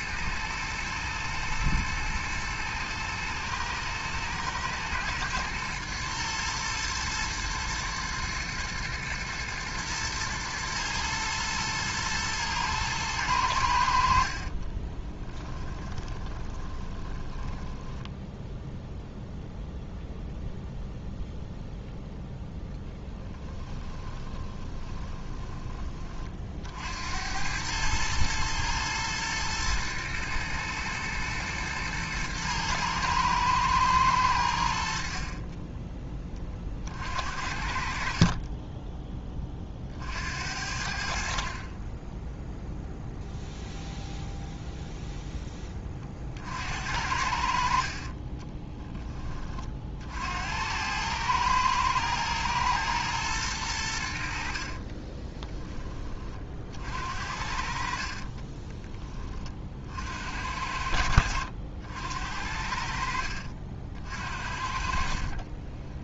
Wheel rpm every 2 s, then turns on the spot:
110, 110, 120, 110, 110, 110, 110, 20, 20, 0, 0, 0, 20, 70, 110, 110, 110, 60, 50, 20, 60, 0, 0, 70, 20, 90, 110, 30, 50, 20, 80, 60, 50.
14-18 24-26 54-56 64-66